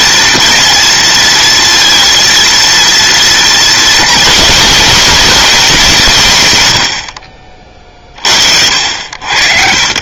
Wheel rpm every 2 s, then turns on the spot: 230, 230, 220, 80, 60.
none